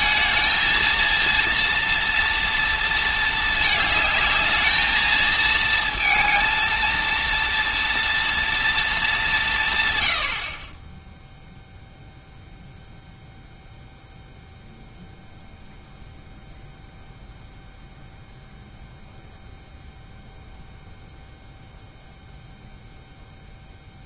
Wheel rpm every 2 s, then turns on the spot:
220, 230, 210, 230, 230, 30, 0, 0, 0, 0, 0, 0.
none